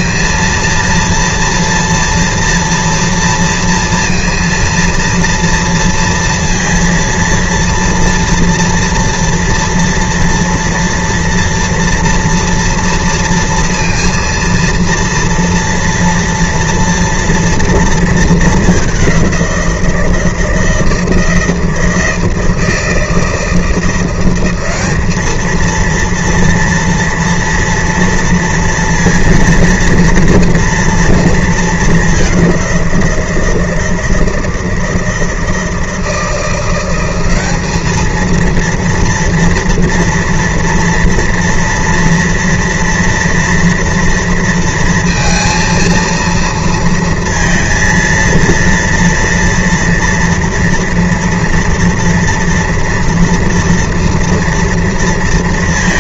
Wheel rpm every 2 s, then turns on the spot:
230, 230, 230, 230, 230, 230, 230, 230, 240, 210, 160, 160, 190, 230, 230, 230, 190, 160, 170, 230, 230, 240, 230, 220, 230, 240, 230, 230.
none